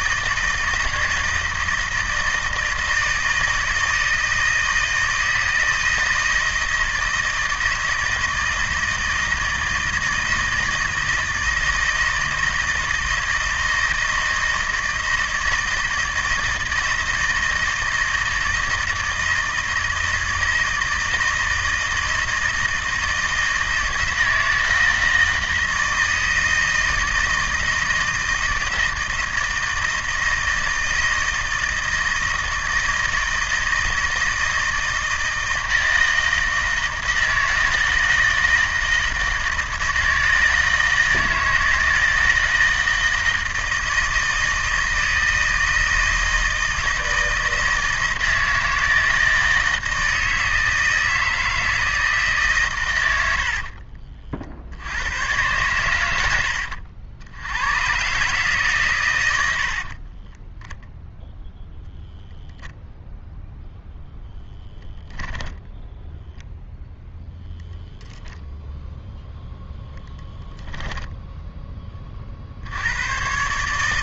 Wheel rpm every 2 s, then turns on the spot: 160, 160, 160, 160, 160, 160, 160, 160, 160, 160, 160, 160, 160, 160, 160, 160, 160, 160, 160, 160, 160, 160, 160, 160, 160, 160, 130, 80, 70, 130, 0, 0, 10, 0, 0, 10, 100.
none